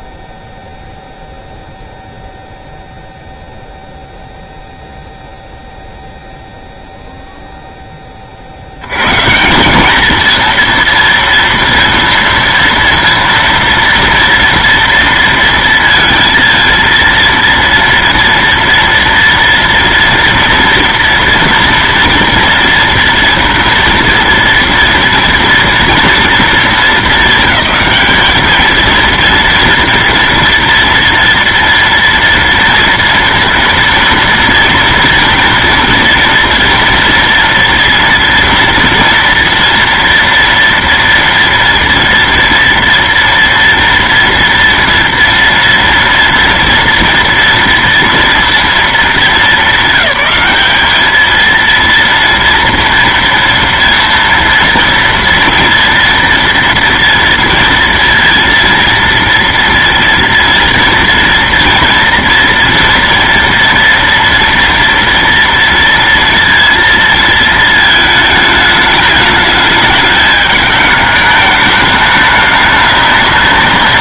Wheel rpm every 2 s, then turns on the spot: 0, 0, 0, 0, 70, 230, 230, 230, 230, 230, 230, 230, 230, 220, 220, 230, 230, 230, 240, 230, 230, 230, 230, 230, 230, 210, 230, 230, 230, 230, 230, 230, 230, 230, 220, 210, 210.
none